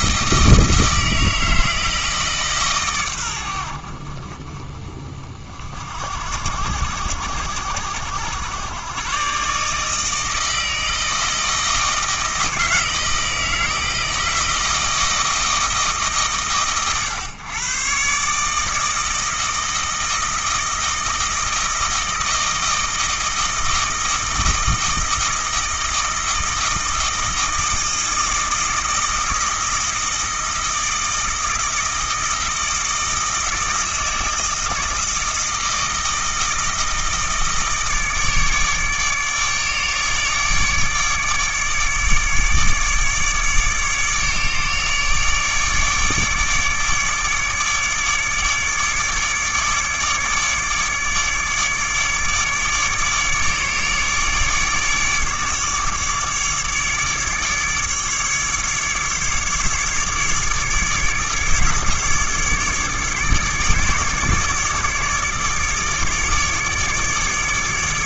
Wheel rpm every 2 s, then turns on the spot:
160, 130, 40, 70, 110, 160, 160, 160, 130, 160, 160, 160, 160, 160, 160, 160, 160, 160, 160, 150, 150, 150, 150, 150, 150, 150, 150, 150, 150, 150, 150, 150, 150, 150.
none